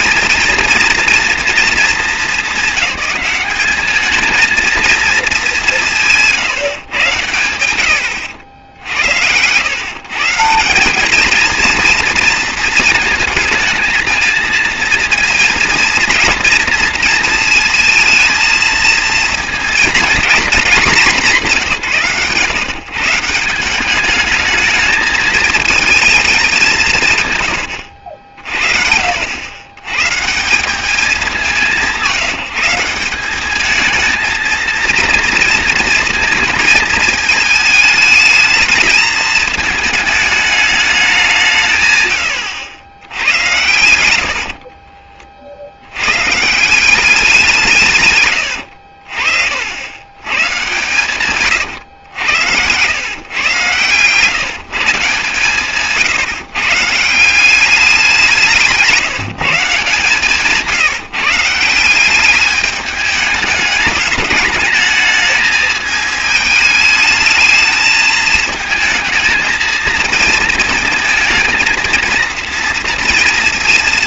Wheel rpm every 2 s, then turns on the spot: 230, 220, 230, 140, 80, 170, 230, 230, 230, 230, 210, 150, 210, 180, 60, 200, 180, 230, 230, 220, 210, 90, 40, 170, 80, 120, 100, 150, 140, 170, 160, 210, 210, 220, 220, 230, 230.
44-46 48-50